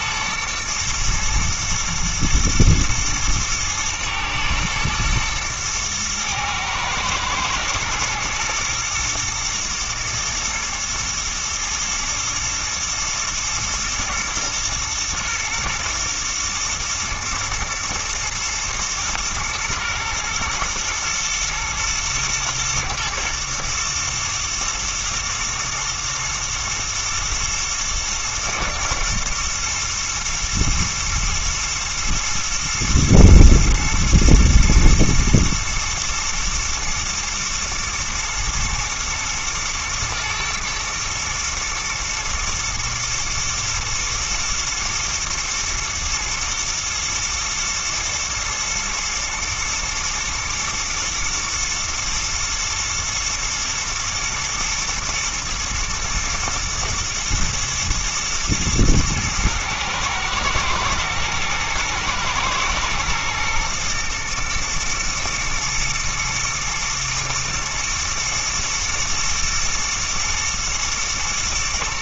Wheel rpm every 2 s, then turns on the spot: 110, 110, 110, 110, 120, 110, 120, 110, 110, 110, 110, 110, 110, 120, 110, 120, 110, 110, 110, 120, 120, 110, 110, 120, 120, 110, 110, 120, 110, 110, 110, 120, 110, 110, 120, 110.
none